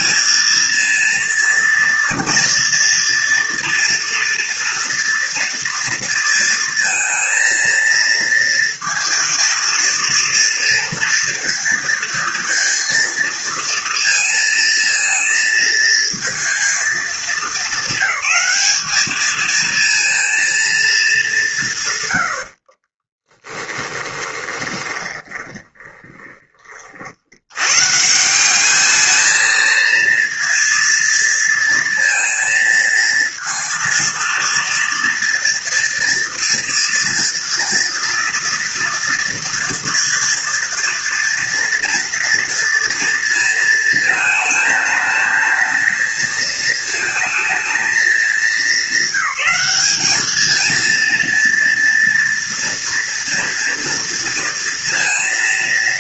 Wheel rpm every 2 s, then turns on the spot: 230, 240, 230, 230, 230, 230, 230, 230, 210, 210, 190, 20, 20, 70, 220, 230, 230, 230, 230, 230, 230, 230, 220, 220, 200, 230, 230, 230.
22-26